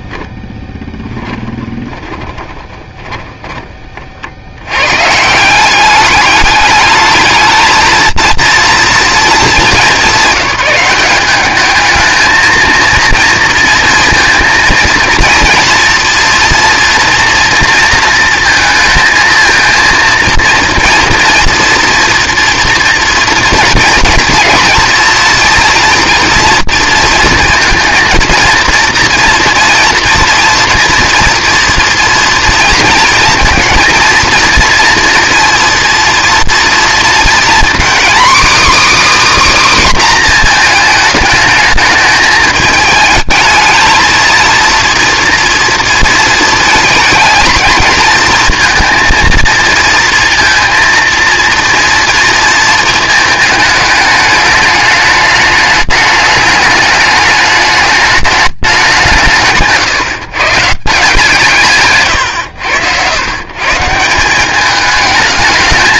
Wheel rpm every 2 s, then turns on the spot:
10, 20, 100, 210, 230, 200, 220, 230, 240, 230, 230, 230, 230, 230, 230, 230, 230, 230, 230, 290, 240, 210, 230, 230, 230, 230, 230, 210, 210, 200, 150, 100, 200.
0-4